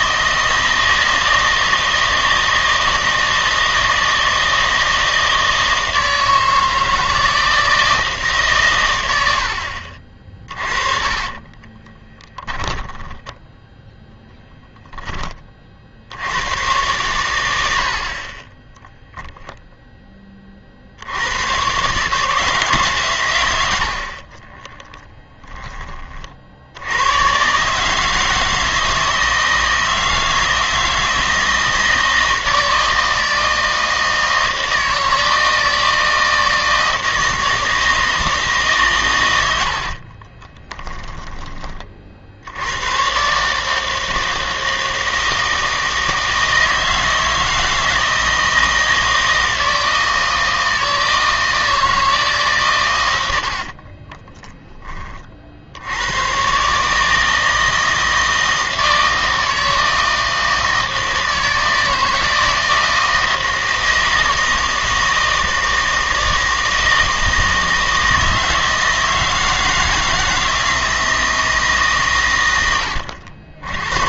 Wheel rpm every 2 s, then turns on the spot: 160, 160, 160, 160, 120, 30, 10, 10, 110, 10, 50, 150, 40, 80, 160, 160, 160, 160, 160, 140, 20, 90, 160, 160, 160, 160, 130, 10, 130, 160, 160, 160, 160, 160, 160, 160, 100.
10-14 18-20 24-26 40-42